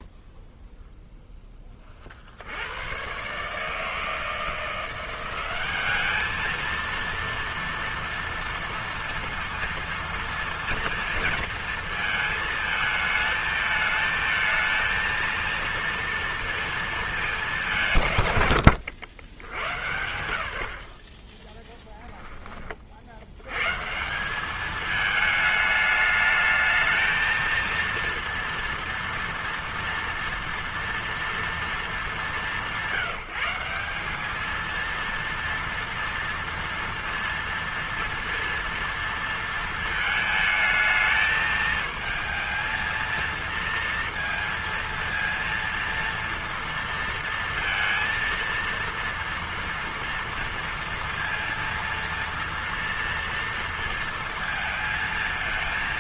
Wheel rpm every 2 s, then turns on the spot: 0, 80, 170, 220, 230, 230, 220, 220, 230, 90, 70, 30, 200, 220, 230, 230, 190, 220, 230, 230, 220, 220, 230, 230, 230, 230, 240, 230.
none